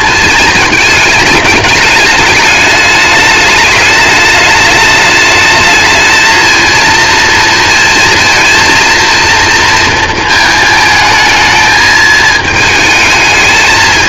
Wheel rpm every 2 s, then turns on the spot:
220, 210, 210, 230, 230, 220, 220.
none